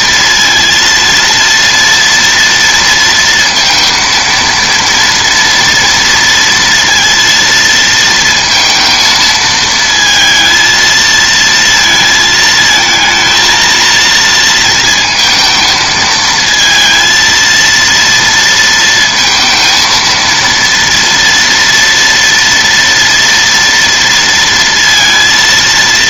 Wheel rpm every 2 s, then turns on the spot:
230, 230, 230, 230, 230, 230, 220, 230, 230, 230, 230, 230, 230.
none